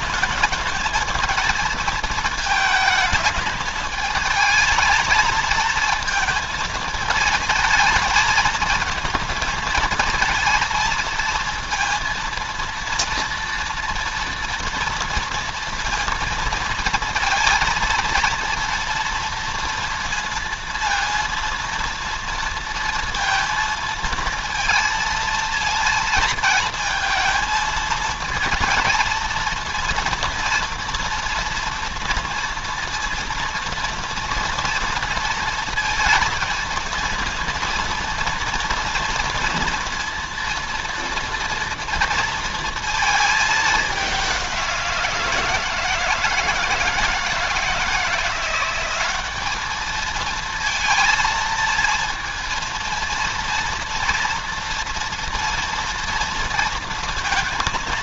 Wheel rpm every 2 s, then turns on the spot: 210, 220, 220, 220, 220, 220, 230, 230, 230, 230, 230, 230, 230, 220, 220, 240, 230, 240, 230, 230, 230, 230, 180, 160, 180, 230, 230, 240, 230.
none